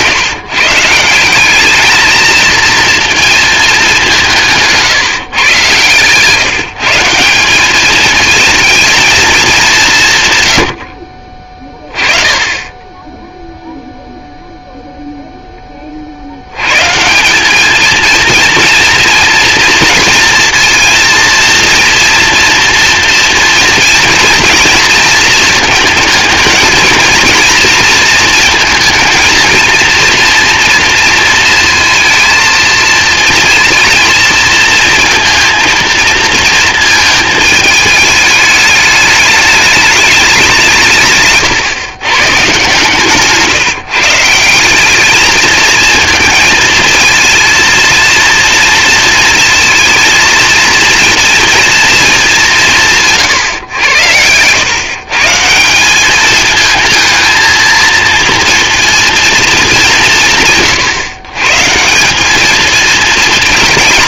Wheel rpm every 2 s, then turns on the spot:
150, 230, 160, 160, 230, 100, 10, 0, 120, 230, 230, 230, 230, 220, 230, 230, 230, 230, 220, 210, 160, 150, 190, 220, 230, 230, 170, 130, 220, 230, 130, 230.
none